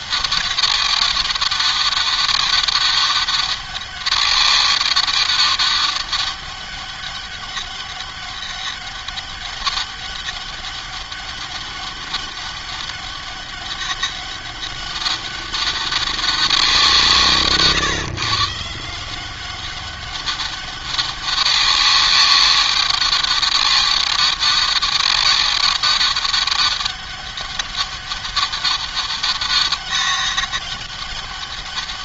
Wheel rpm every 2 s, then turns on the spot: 200, 200, 200, 200, 200, 200, 200, 200, 160, 170, 200, 200, 200, 200, 200, 200.
none